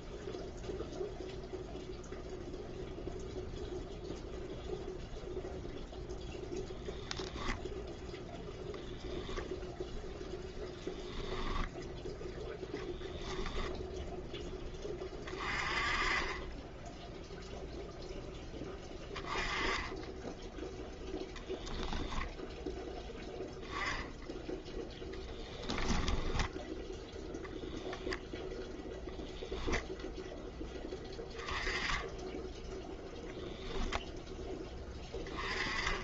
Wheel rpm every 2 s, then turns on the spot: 0, 0, 0, 0, 0, 0, 0, 20, 10, 10, 0, 10, 10, 10, 0, 10, 10, 10.
none